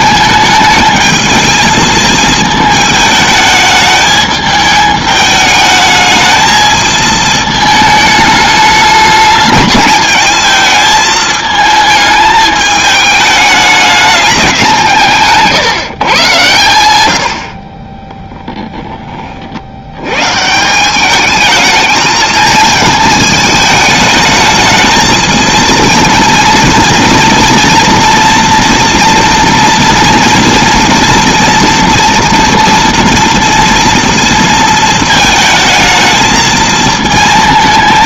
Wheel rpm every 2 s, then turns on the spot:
220, 220, 210, 220, 210, 220, 210, 200, 120, 10, 150, 220, 220, 230, 230, 230, 230, 230, 220.
none